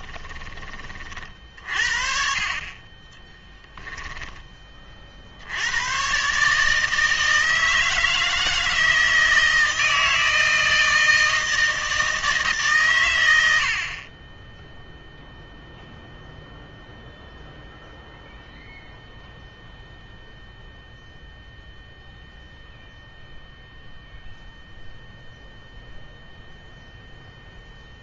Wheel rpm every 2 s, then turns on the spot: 30, 30, 20, 150, 160, 160, 140, 0, 0, 0, 0, 0, 0, 0.
none